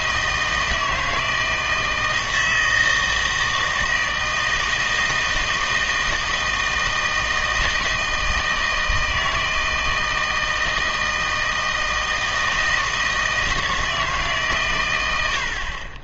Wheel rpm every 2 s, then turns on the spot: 160, 160, 160, 160, 160, 160, 160, 130.
none